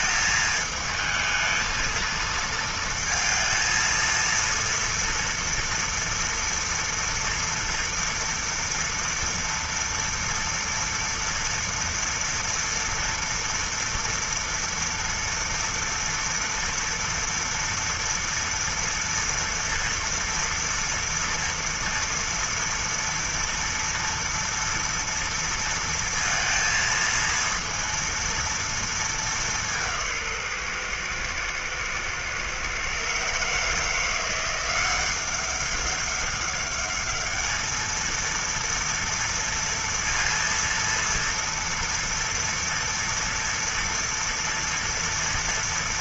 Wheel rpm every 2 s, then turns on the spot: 220, 230, 230, 230, 230, 230, 230, 230, 230, 230, 230, 230, 230, 230, 230, 150, 120, 170, 200, 230, 230, 230, 230.
none